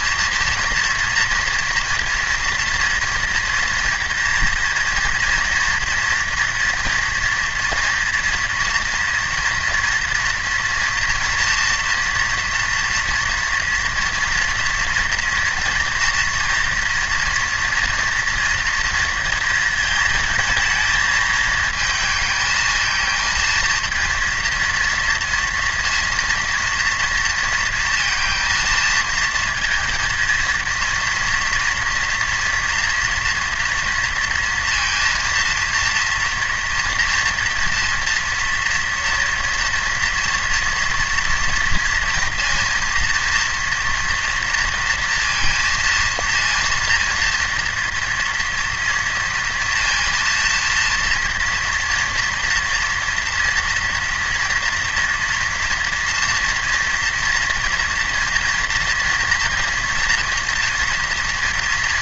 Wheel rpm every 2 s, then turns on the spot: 230, 230, 230, 230, 230, 240, 230, 240, 230, 230, 220, 220, 230, 230, 230, 230, 230, 230, 230, 230, 230, 230, 230, 230, 240, 230, 230, 230, 230, 240, 230.
none